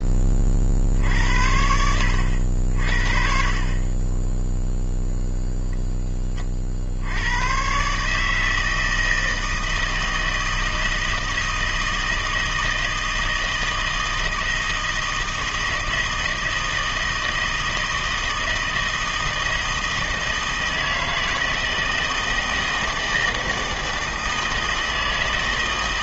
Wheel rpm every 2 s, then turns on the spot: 50, 60, 0, 50, 160, 160, 160, 160, 160, 160, 160, 160, 160.
none